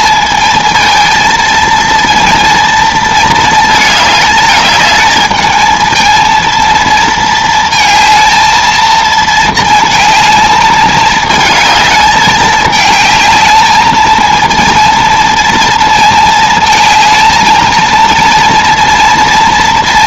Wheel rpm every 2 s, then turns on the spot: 220, 230, 210, 230, 220, 220, 210, 230, 220, 230.
none